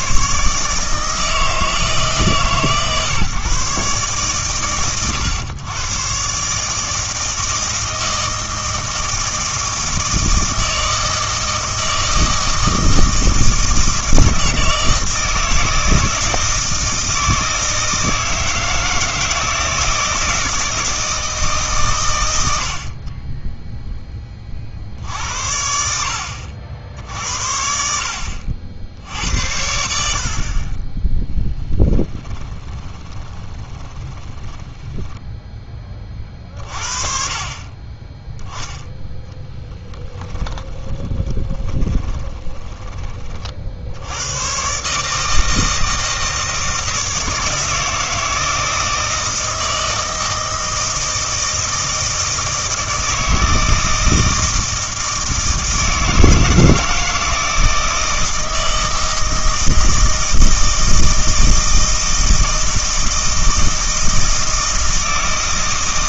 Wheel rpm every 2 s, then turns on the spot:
150, 140, 120, 150, 160, 160, 160, 160, 160, 160, 160, 70, 50, 60, 70, 40, 30, 20, 40, 0, 10, 10, 130, 160, 160, 160, 160, 160, 160, 160, 160, 160, 160.
32-36 40-44